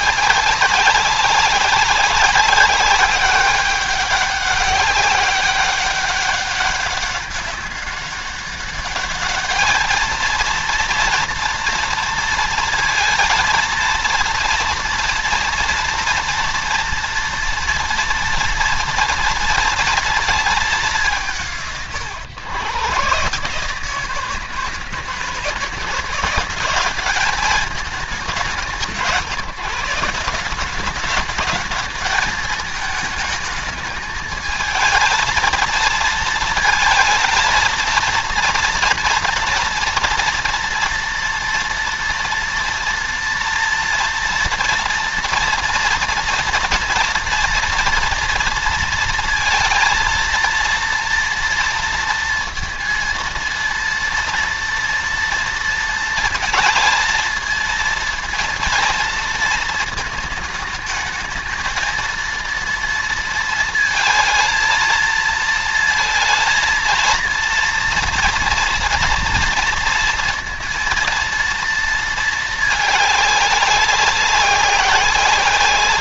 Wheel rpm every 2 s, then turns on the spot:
190, 190, 200, 200, 200, 230, 220, 230, 230, 230, 180, 130, 160, 210, 170, 200, 220, 220, 230, 240, 230, 230, 230, 230, 230, 230, 230, 230, 230, 230, 220, 230, 220, 230, 240, 230, 210, 190.
none